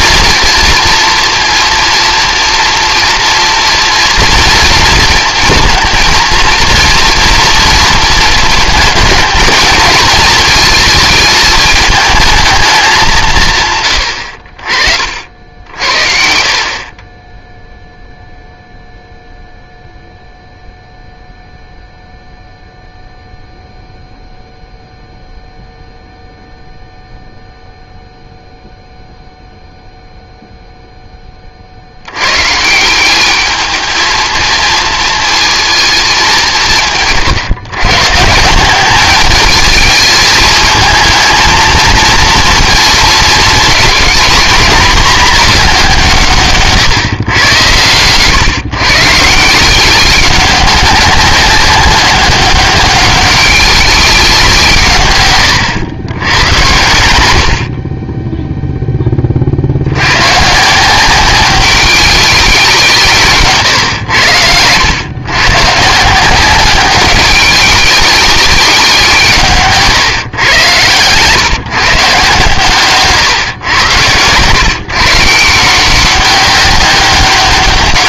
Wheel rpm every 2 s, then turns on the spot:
230, 230, 230, 230, 220, 220, 200, 60, 30, 0, 0, 0, 0, 0, 0, 0, 180, 230, 160, 190, 220, 230, 220, 140, 130, 190, 200, 140, 90, 10, 170, 180, 110, 190, 180, 120, 140, 140, 200.
none